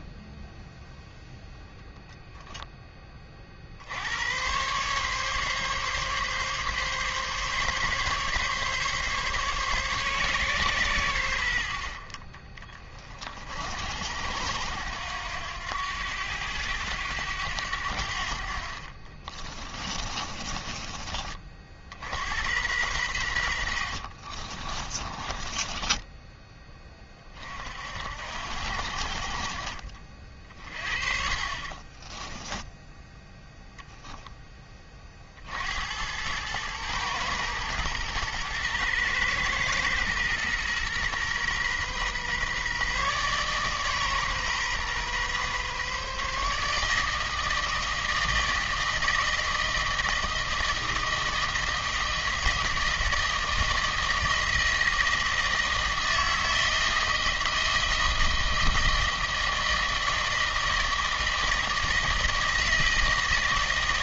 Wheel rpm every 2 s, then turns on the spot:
0, 20, 130, 140, 140, 110, 30, 80, 100, 40, 30, 100, 20, 20, 60, 40, 10, 40, 110, 110, 120, 140, 130, 160, 160, 160, 160, 160, 160, 160, 160, 160.
24-26 30-34